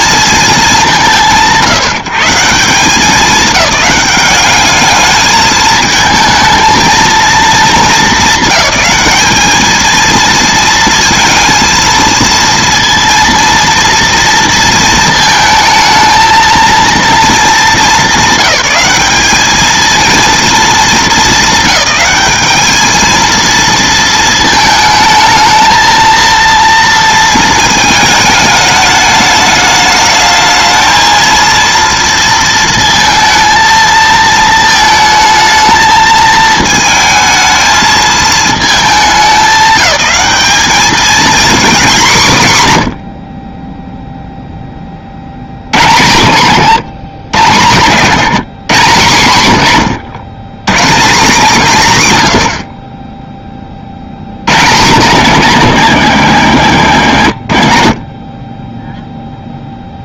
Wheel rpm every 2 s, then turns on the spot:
210, 160, 210, 220, 210, 230, 230, 230, 230, 200, 230, 210, 220, 230, 220, 220, 230, 220, 220, 220, 190, 140, 20, 120, 140, 130, 50, 120, 90, 10.
46-48